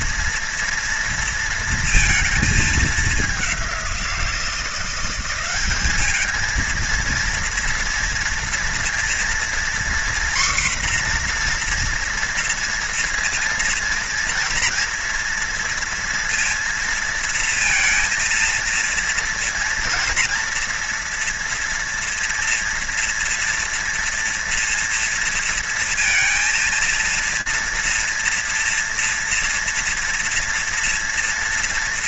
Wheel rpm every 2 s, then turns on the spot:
230, 220, 180, 220, 230, 250, 230, 230, 230, 230, 230, 230, 230, 230, 230, 230.
none